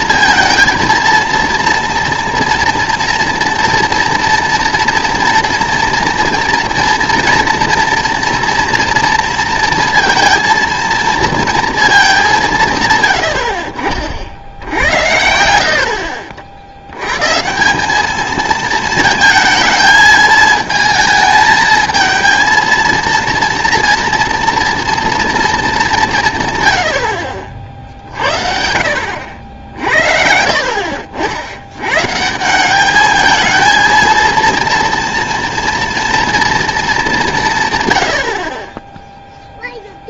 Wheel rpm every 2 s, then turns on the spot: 230, 230, 230, 230, 240, 230, 170, 70, 70, 220, 220, 230, 230, 110, 60, 60, 180, 230, 220, 20.
none